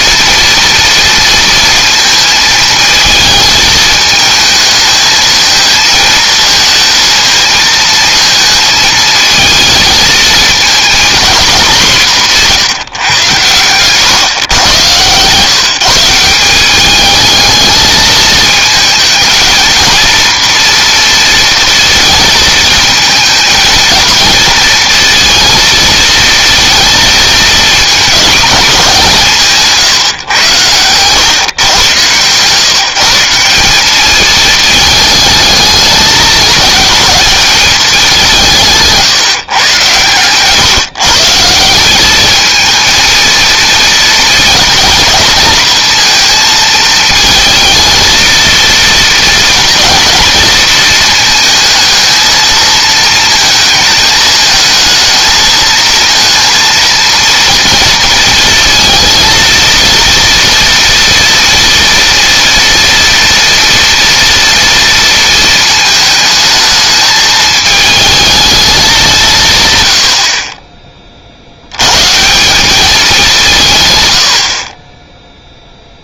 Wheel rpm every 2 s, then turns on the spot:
230, 220, 220, 220, 220, 230, 170, 120, 200, 220, 230, 220, 230, 230, 200, 110, 160, 220, 210, 160, 140, 230, 230, 230, 220, 220, 230, 220, 230, 230, 230, 230, 230, 220, 200, 30, 190, 40.
30-32